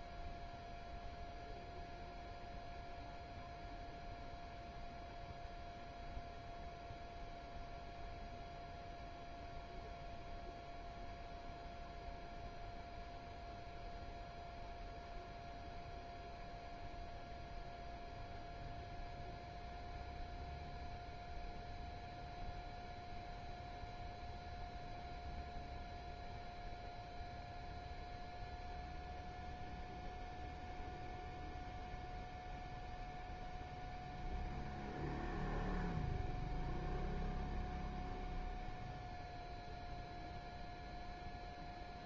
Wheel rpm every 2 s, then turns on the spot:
0, 0, 0, 0, 0, 0, 0, 0, 0, 0, 0, 0, 0, 0, 0, 0, 0, 0, 0, 0, 0.
none